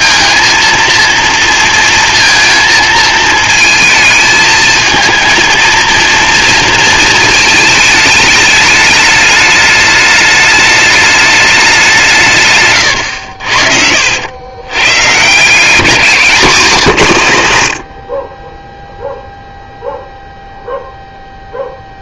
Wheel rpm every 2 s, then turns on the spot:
230, 220, 220, 230, 210, 210, 130, 110, 190, 10, 0.
none